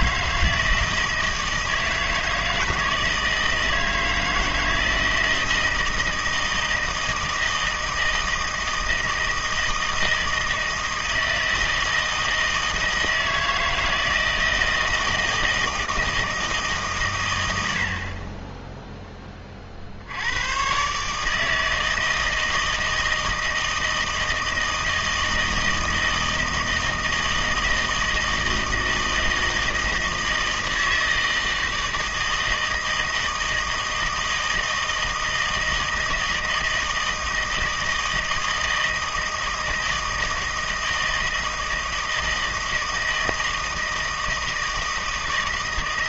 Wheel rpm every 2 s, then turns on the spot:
160, 160, 160, 160, 160, 160, 160, 160, 150, 0, 130, 160, 160, 160, 160, 160, 160, 160, 160, 160, 160, 160, 160.
none